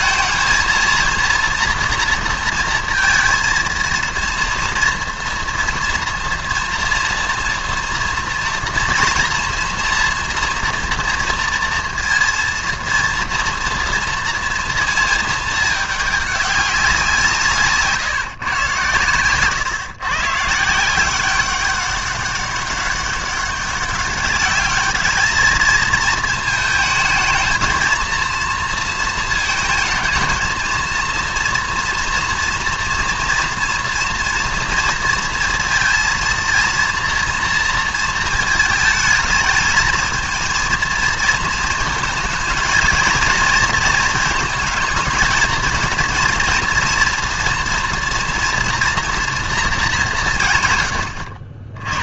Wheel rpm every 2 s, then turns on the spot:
230, 230, 230, 230, 230, 230, 230, 230, 180, 110, 170, 200, 210, 220, 230, 230, 230, 240, 230, 220, 230, 230, 220, 230, 240, 120.
none